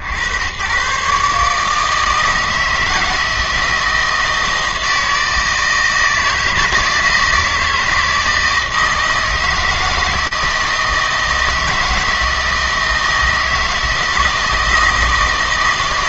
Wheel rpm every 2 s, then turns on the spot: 90, 160, 160, 160, 160, 160, 160, 170.
none